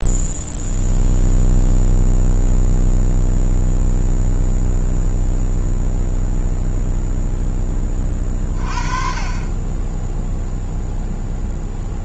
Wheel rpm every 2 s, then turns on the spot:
0, 0, 0, 0, 30, 0.
none